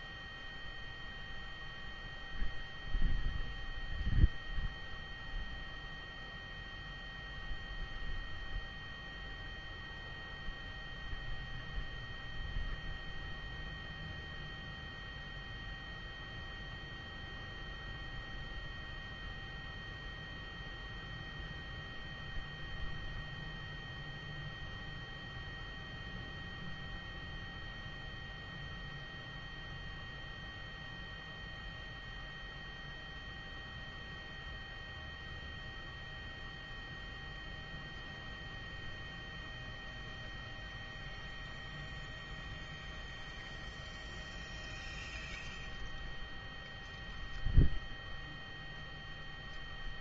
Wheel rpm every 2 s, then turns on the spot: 0, 0, 0, 0, 0, 0, 0, 0, 0, 0, 0, 0, 0, 0, 0, 0, 0, 0, 0, 0, 0, 0, 0, 0, 0.
none